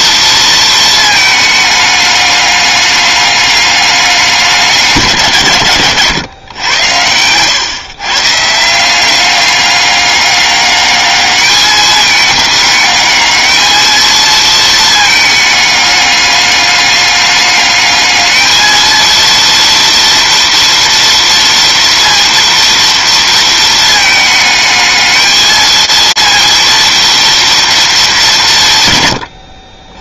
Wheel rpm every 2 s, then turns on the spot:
230, 200, 180, 100, 170, 210, 210, 220, 210, 220, 230, 230, 220, 230, 130.
none